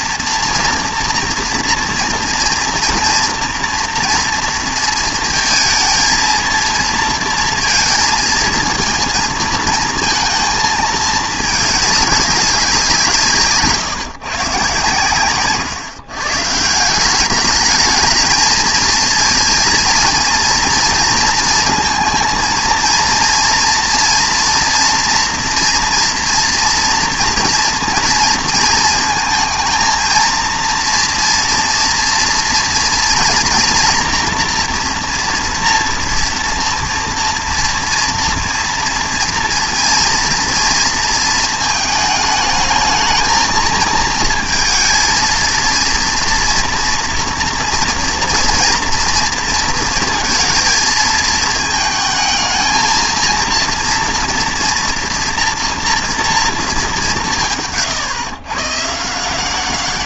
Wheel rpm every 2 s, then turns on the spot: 230, 230, 230, 230, 230, 220, 200, 140, 170, 220, 230, 230, 240, 230, 230, 230, 230, 240, 230, 230, 230, 220, 220, 230, 230, 220, 220, 240, 220, 140.
none